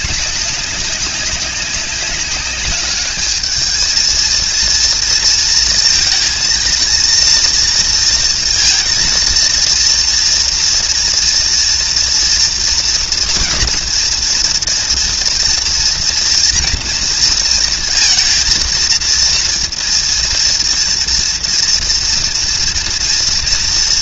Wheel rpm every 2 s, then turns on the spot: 190, 200, 230, 230, 230, 240, 230, 230, 230, 230, 230, 230.
none